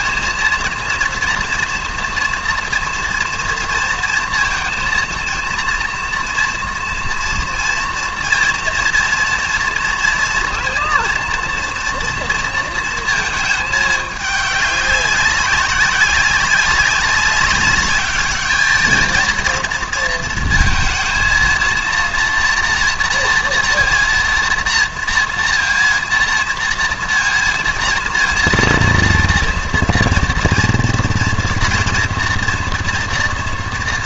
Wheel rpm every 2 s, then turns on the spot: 230, 240, 230, 230, 230, 230, 230, 200, 200, 220, 230, 230, 230, 230, 230, 230, 230.
none